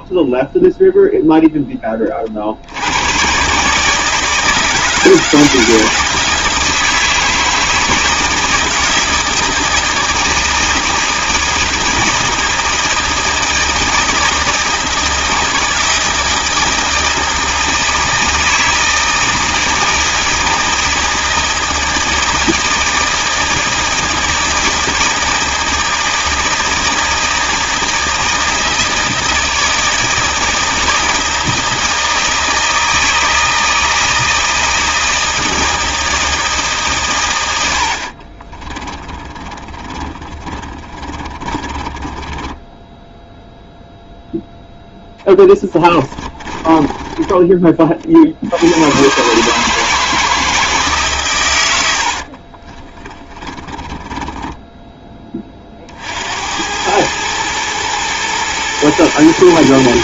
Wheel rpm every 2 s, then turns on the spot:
0, 70, 160, 160, 160, 160, 170, 160, 160, 160, 160, 160, 160, 160, 160, 160, 160, 160, 150, 30, 40, 20, 0, 20, 80, 160, 40, 10, 80, 110.
38-44 46-48 52-56